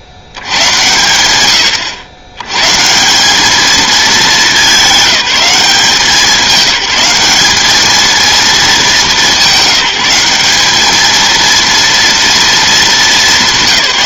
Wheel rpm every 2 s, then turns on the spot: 100, 130, 200, 190, 220, 210, 220.
none